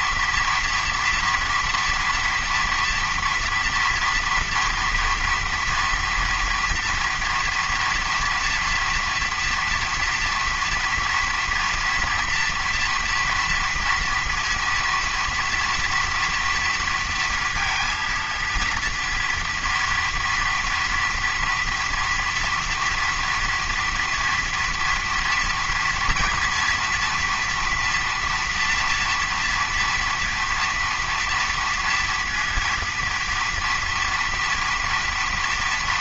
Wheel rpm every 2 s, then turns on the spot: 230, 230, 230, 230, 230, 230, 230, 230, 230, 230, 230, 230, 240, 230, 230, 230, 230, 230.
none